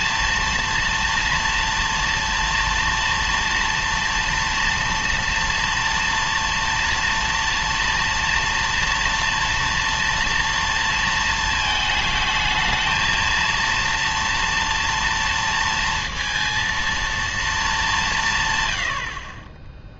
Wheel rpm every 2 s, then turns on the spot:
230, 230, 230, 230, 230, 230, 220, 230, 230, 110.
none